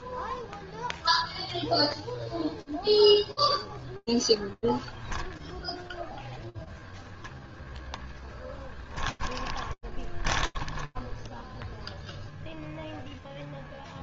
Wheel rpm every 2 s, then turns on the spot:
0, 0, 0, 10, 20, 0, 0.
6-10